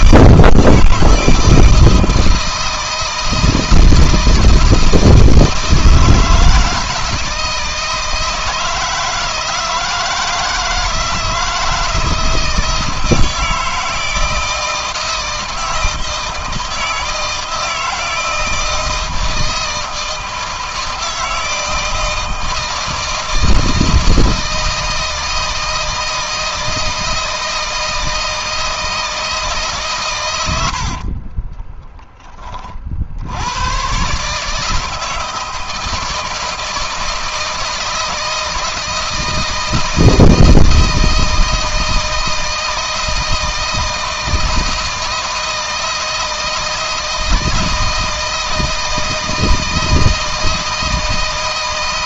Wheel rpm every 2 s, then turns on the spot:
160, 160, 160, 160, 160, 160, 160, 160, 160, 160, 160, 160, 160, 160, 160, 60, 50, 160, 170, 160, 160, 160, 160, 160, 160, 160.
30-32